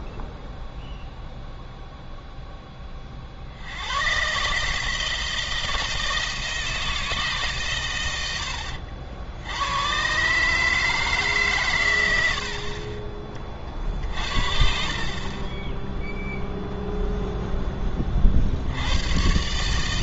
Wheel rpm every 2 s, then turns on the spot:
0, 10, 150, 160, 70, 150, 50, 50, 0, 70.
none